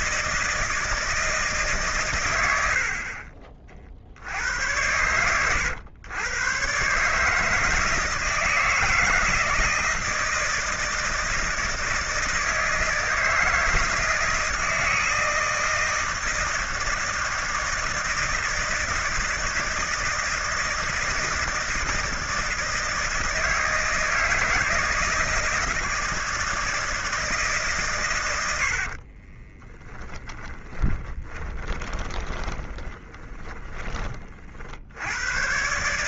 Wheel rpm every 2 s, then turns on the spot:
160, 80, 90, 130, 160, 160, 160, 160, 160, 160, 160, 160, 160, 160, 70, 20, 30, 60.
2-4 30-34